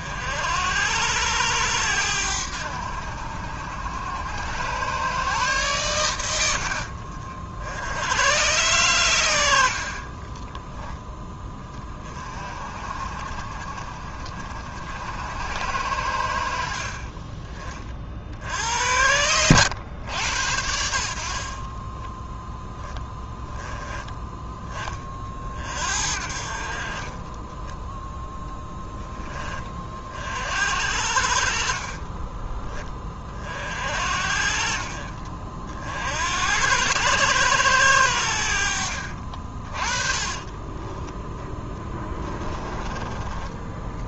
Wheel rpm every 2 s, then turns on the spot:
90, 80, 120, 60, 110, 10, 50, 70, 40, 90, 70, 10, 20, 40, 30, 60, 20, 40, 100, 60, 20, 20.
38-42